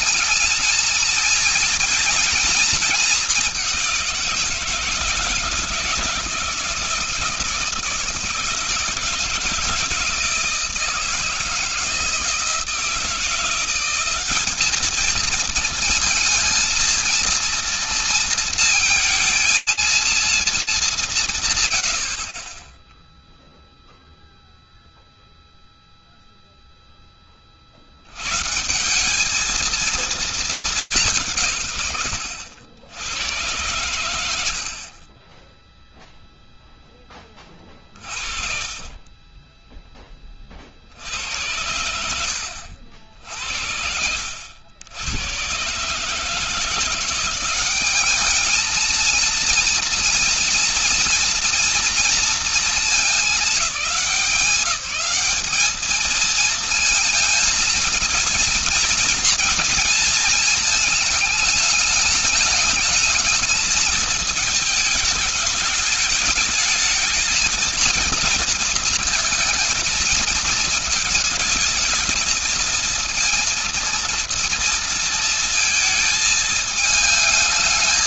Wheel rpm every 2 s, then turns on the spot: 230, 230, 170, 160, 170, 160, 170, 220, 230, 230, 200, 0, 0, 30, 200, 150, 100, 20, 20, 20, 90, 70, 110, 180, 230, 230, 200, 210, 230, 230, 220, 220, 210, 220, 230, 220, 230, 220, 220.
none